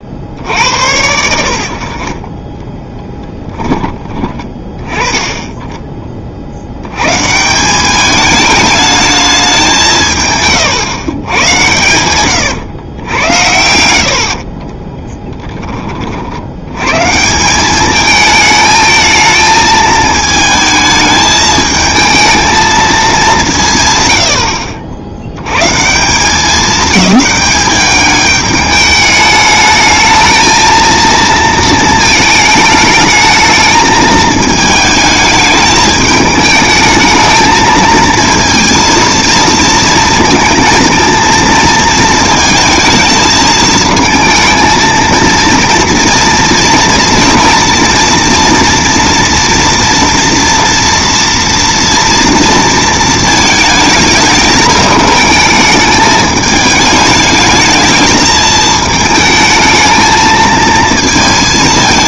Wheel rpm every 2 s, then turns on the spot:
70, 10, 20, 90, 210, 140, 110, 20, 100, 220, 220, 220, 50, 200, 210, 220, 220, 220, 220, 230, 230, 220, 230, 230, 230, 230, 230, 210, 210, 220, 220.
2-4 10-16